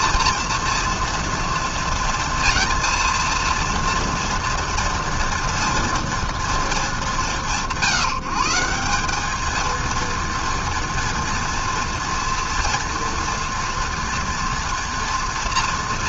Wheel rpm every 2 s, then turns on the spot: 230, 230, 230, 210, 170, 230, 230, 230.
none